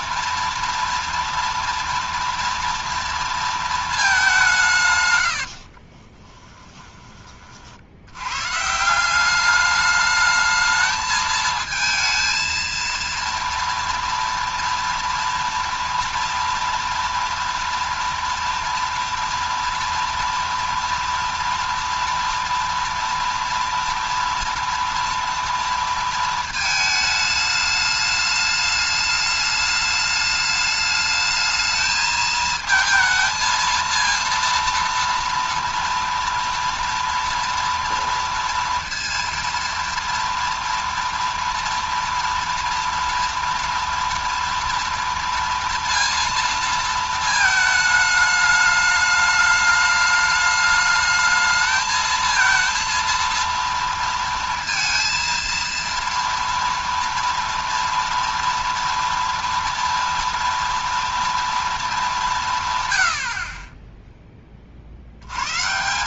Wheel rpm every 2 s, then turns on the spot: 230, 230, 170, 10, 140, 220, 230, 230, 230, 230, 230, 230, 230, 220, 210, 210, 220, 230, 230, 230, 230, 230, 230, 230, 220, 210, 230, 230, 230, 230, 230, 210, 40.
none